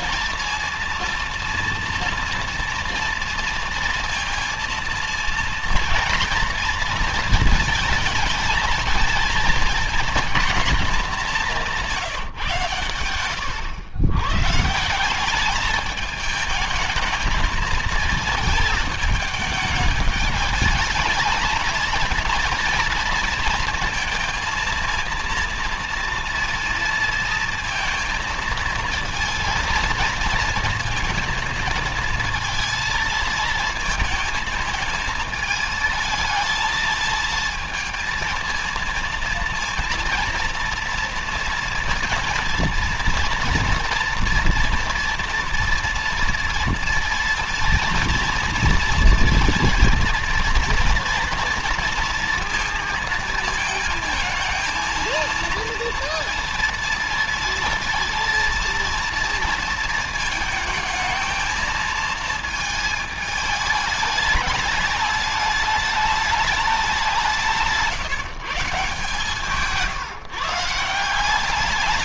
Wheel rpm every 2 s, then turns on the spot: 230, 230, 230, 230, 230, 220, 130, 150, 220, 220, 210, 230, 230, 230, 230, 230, 230, 220, 220, 230, 230, 230, 230, 230, 230, 230, 230, 220, 230, 230, 220, 220, 210, 190, 140, 160.
none